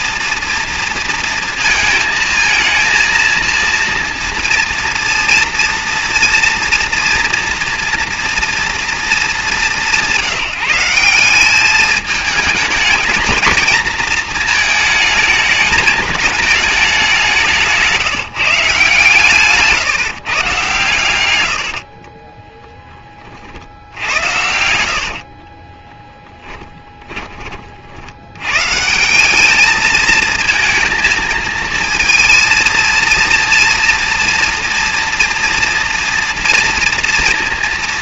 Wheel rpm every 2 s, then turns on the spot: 230, 220, 230, 240, 230, 170, 220, 220, 200, 150, 130, 10, 60, 10, 130, 220, 230, 230, 230.
26-28